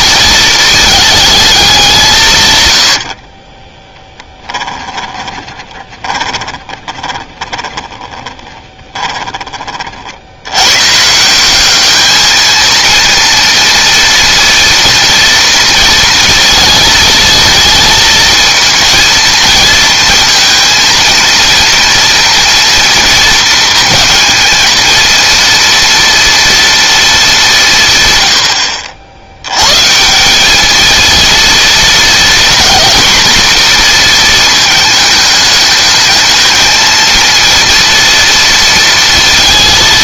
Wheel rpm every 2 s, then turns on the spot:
220, 110, 20, 20, 20, 130, 230, 230, 230, 230, 230, 230, 230, 230, 70, 220, 230, 220, 220, 230.
4-10